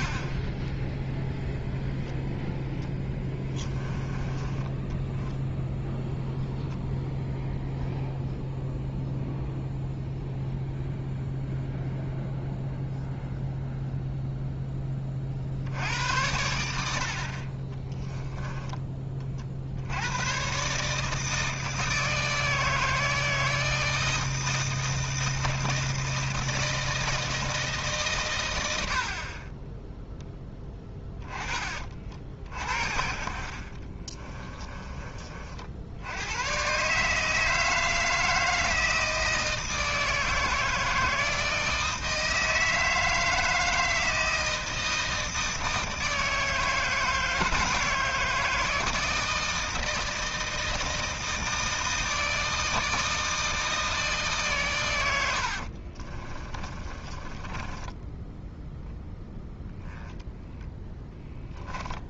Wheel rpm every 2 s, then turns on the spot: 0, 10, 10, 0, 0, 0, 0, 20, 70, 20, 140, 160, 160, 160, 80, 10, 60, 30, 140, 160, 160, 160, 160, 160, 160, 160, 160, 110, 20, 0, 10.
2-4 32-34 56-58 60-62